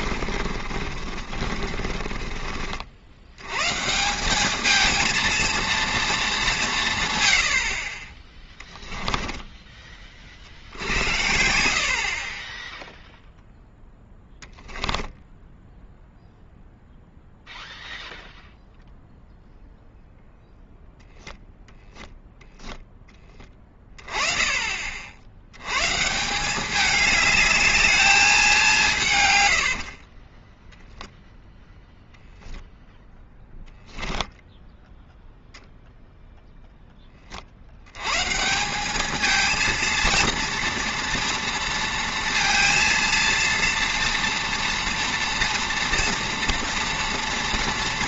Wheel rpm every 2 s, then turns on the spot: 40, 40, 210, 180, 10, 50, 10, 10, 0, 0, 0, 0, 30, 190, 190, 10, 0, 0, 0, 170, 230, 230, 230, 230.
0-2 14-16 30-32